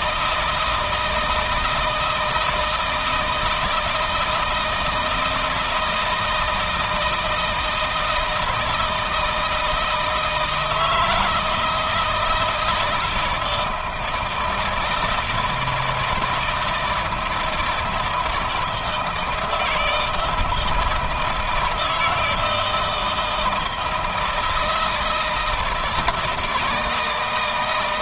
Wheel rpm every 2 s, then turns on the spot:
160, 160, 160, 160, 160, 160, 170, 160, 160, 160, 160, 160, 160, 160.
none